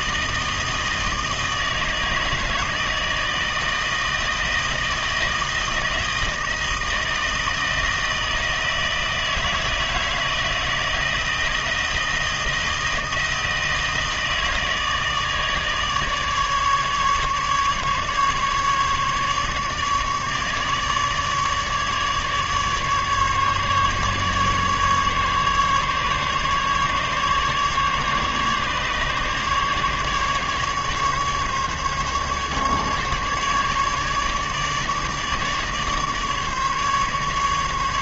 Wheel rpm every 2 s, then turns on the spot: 160, 160, 160, 160, 160, 160, 160, 160, 150, 150, 150, 150, 150, 140, 150, 150, 150, 150, 150.
none